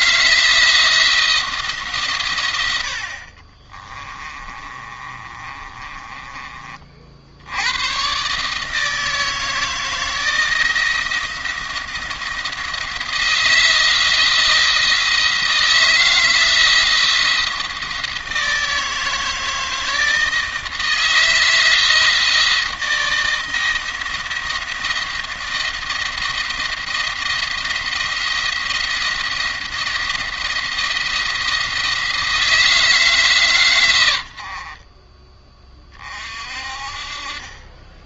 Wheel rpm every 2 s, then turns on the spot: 170, 90, 30, 40, 150, 160, 160, 160, 170, 160, 160, 170, 170, 170, 170, 170, 160, 40, 40.
2-6